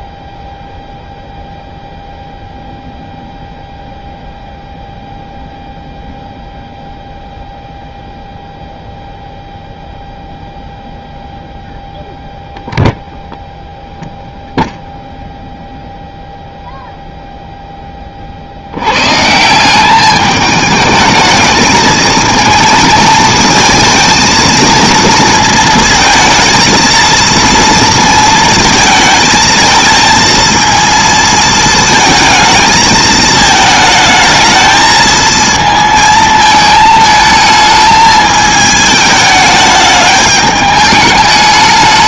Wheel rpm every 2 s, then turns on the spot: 0, 0, 0, 0, 0, 0, 0, 0, 0, 70, 210, 220, 230, 220, 230, 230, 220, 220, 220, 220, 210.
none